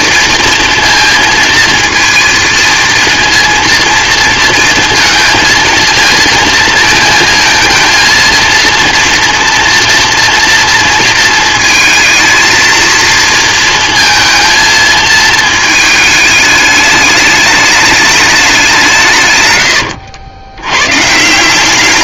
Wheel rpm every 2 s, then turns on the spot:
230, 230, 230, 230, 230, 230, 230, 220, 210, 200, 100.
none